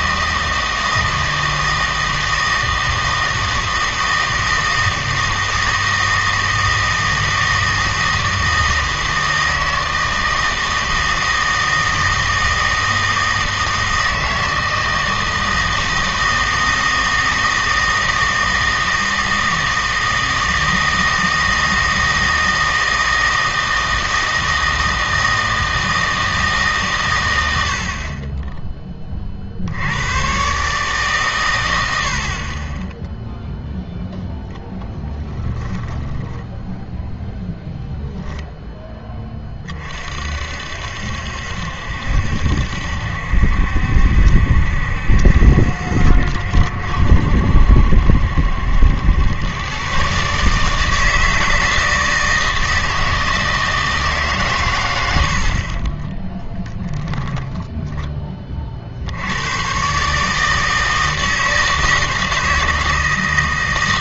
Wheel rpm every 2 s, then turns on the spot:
160, 160, 160, 160, 160, 160, 160, 160, 160, 160, 160, 160, 160, 150, 10, 140, 20, 10, 10, 0, 60, 70, 70, 70, 80, 150, 160, 110, 10, 40, 160, 160.
56-58